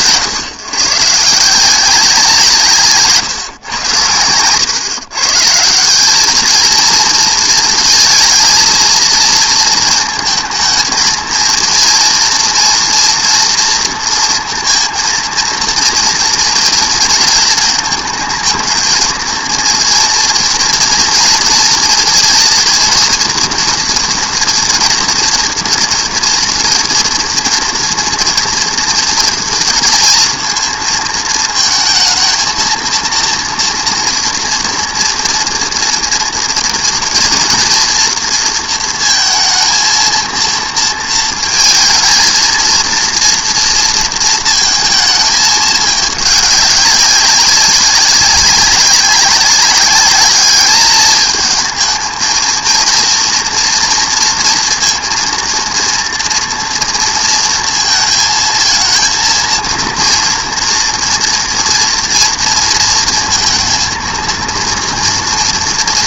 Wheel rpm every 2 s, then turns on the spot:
140, 160, 130, 220, 220, 220, 230, 230, 230, 220, 230, 230, 230, 230, 230, 230, 230, 230, 240, 230, 230, 230, 220, 200, 200, 210, 230, 230, 230, 220, 240, 230, 230.
none